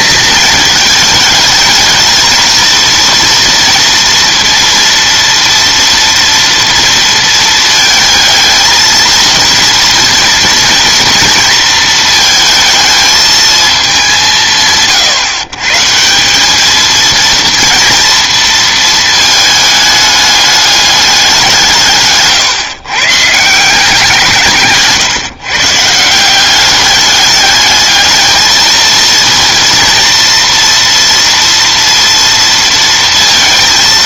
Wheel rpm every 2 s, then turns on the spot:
220, 230, 230, 230, 220, 230, 220, 150, 210, 230, 210, 130, 150, 200, 220, 230, 230.
none